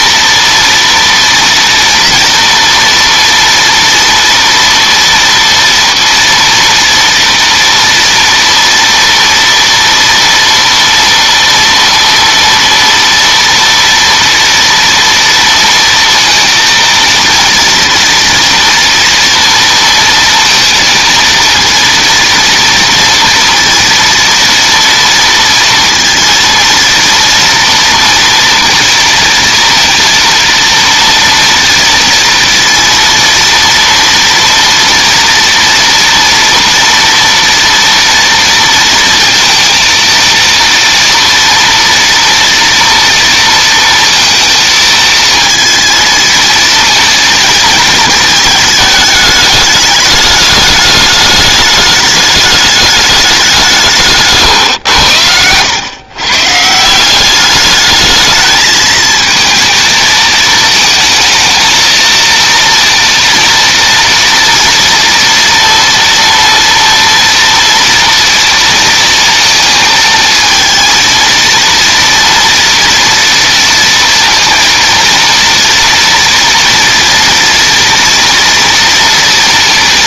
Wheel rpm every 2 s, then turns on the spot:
230, 240, 230, 230, 230, 230, 230, 230, 230, 230, 230, 230, 230, 230, 230, 230, 230, 230, 230, 230, 230, 230, 230, 230, 220, 210, 210, 150, 130, 210, 220, 230, 240, 230, 230, 220, 230, 230, 230, 230.
none